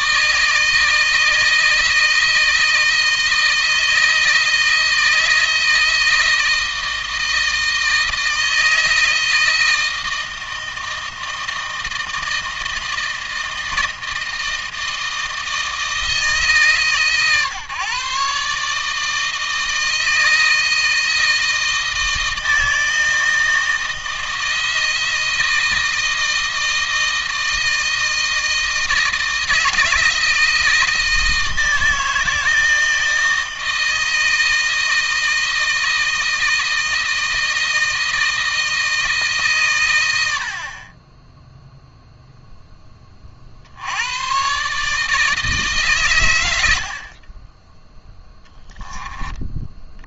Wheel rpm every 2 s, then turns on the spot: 160, 160, 160, 160, 160, 160, 160, 160, 150, 150, 160, 160, 160, 160, 160, 160, 160, 160, 160, 160, 40, 10, 140, 70, 10.
none